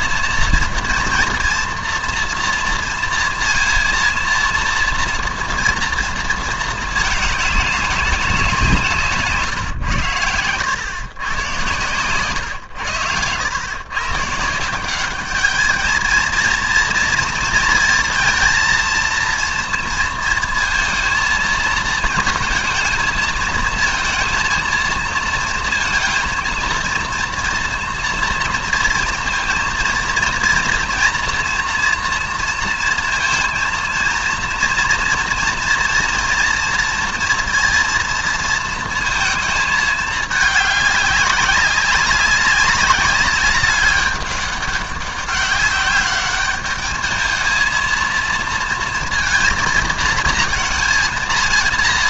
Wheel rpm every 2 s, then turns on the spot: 230, 230, 230, 220, 170, 110, 100, 170, 230, 230, 230, 220, 230, 230, 230, 230, 230, 230, 230, 230, 210, 200, 200, 210, 230, 220.
none